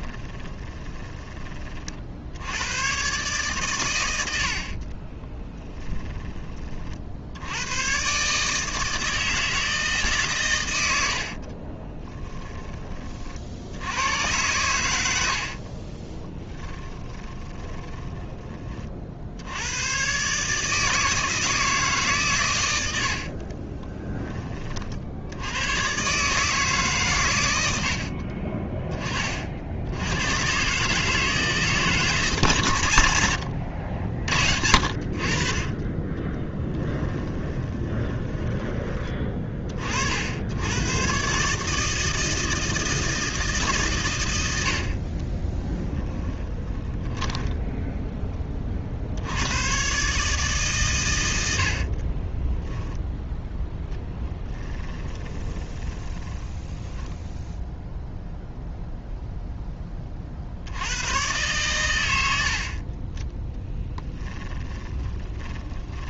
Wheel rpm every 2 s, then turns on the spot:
20, 110, 40, 40, 160, 100, 30, 90, 10, 40, 160, 80, 50, 140, 30, 140, 120, 60, 20, 20, 110, 160, 50, 10, 50, 120, 10, 10, 10, 0, 90, 40, 20.
0-2 4-6 10-12 16-18 22-24 36-38 46-48 54-58 64-66